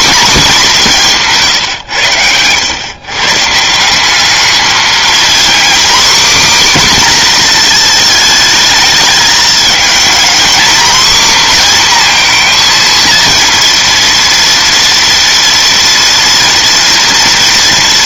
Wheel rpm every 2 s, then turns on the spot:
200, 120, 220, 260, 220, 260, 240, 230, 230.
none